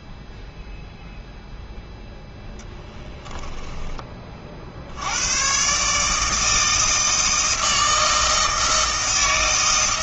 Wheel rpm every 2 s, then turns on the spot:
0, 10, 50, 160, 160.
2-4